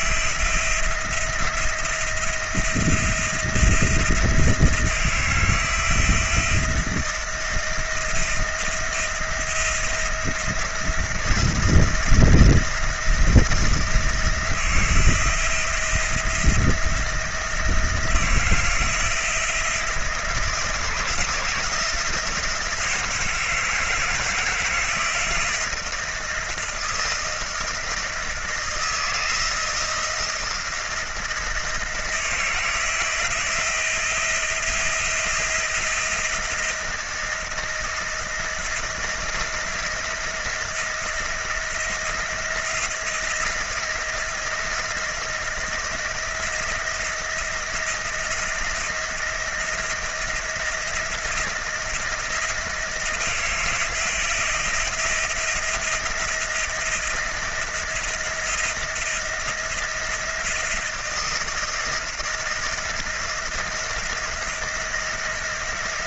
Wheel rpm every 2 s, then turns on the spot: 170, 170, 170, 170, 170, 160, 170, 170, 170, 170, 160, 160, 160, 170, 160, 170, 160, 170, 170, 170, 170, 170, 170, 170, 170, 160, 170, 170, 170, 170, 170, 170, 170.
none